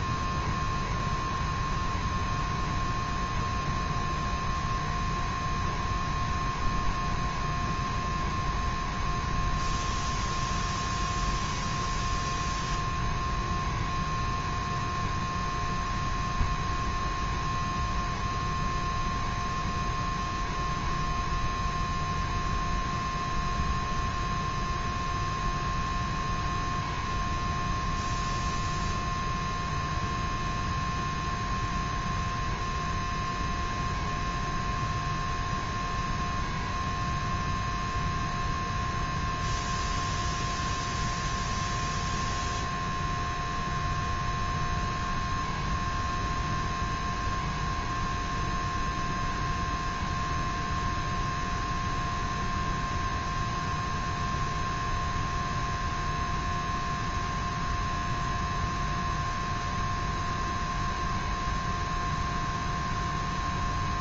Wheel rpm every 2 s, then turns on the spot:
0, 0, 0, 0, 0, 0, 0, 0, 0, 0, 0, 0, 0, 0, 0, 0, 0, 0, 0, 0, 0, 0, 0, 0, 0, 0, 0, 0, 0, 0, 0, 0.
none